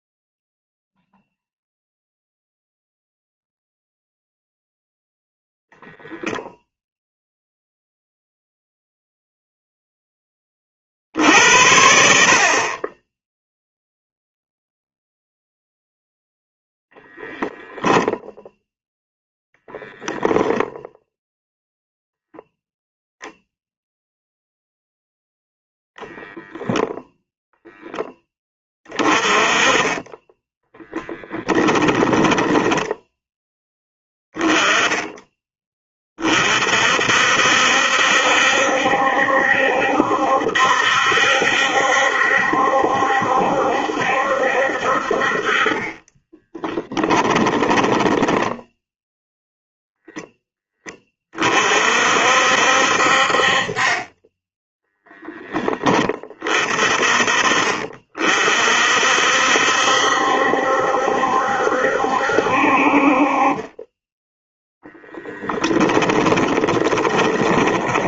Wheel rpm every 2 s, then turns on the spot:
0, 0, 0, 0, 0, 40, 30, 0, 0, 0, 0, 0, 0, 0, 20, 10, 10, 10, 50, 70, 70, 70, 60, 10, 10, 20, 60, 10, 40, 50, 70, 60, 0, 20.
30-34 46-50 66-68